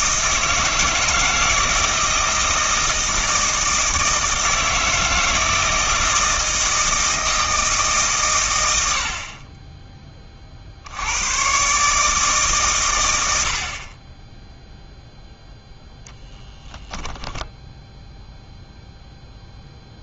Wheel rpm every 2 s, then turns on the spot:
160, 160, 160, 160, 90, 70, 120, 0, 0, 0.
none